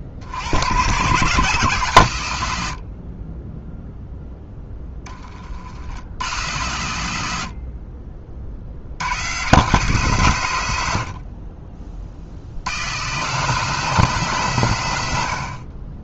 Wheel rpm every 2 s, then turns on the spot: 100, 70, 10, 110, 80, 90, 100, 130.
none